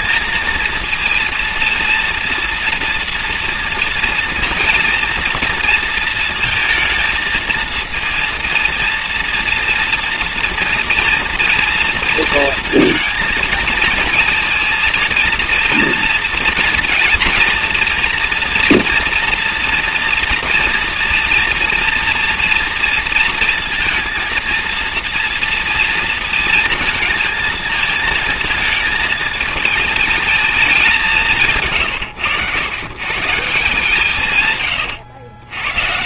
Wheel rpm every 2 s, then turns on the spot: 230, 230, 230, 230, 230, 230, 230, 230, 230, 230, 230, 230, 230, 230, 230, 220, 110, 120.
none